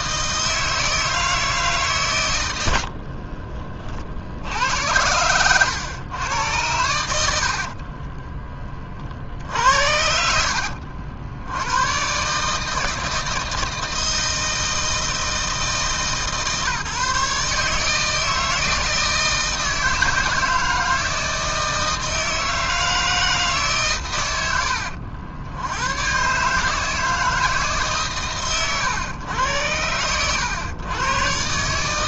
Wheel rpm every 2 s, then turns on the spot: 160, 70, 90, 90, 40, 70, 160, 160, 150, 160, 160, 160, 80, 160, 120, 110.
2-4